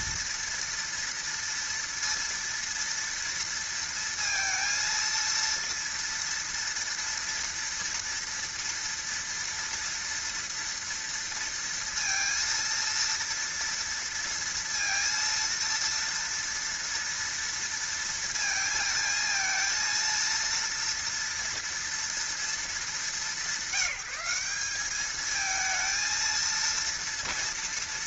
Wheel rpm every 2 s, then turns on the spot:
230, 230, 230, 230, 230, 230, 230, 230, 230, 230, 230, 210, 210, 230.
none